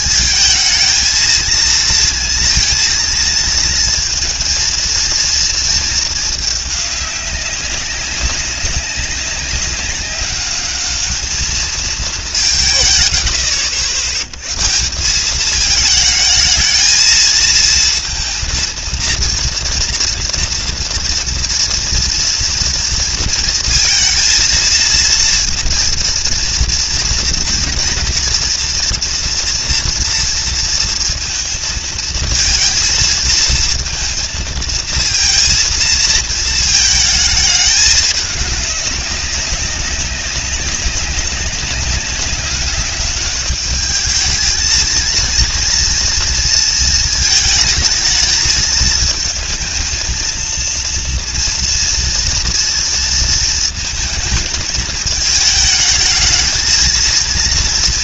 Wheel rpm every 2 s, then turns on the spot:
220, 230, 230, 200, 200, 210, 120, 160, 220, 230, 230, 230, 230, 230, 240, 230, 220, 230, 220, 200, 200, 200, 230, 220, 220, 230, 230, 220, 230.
none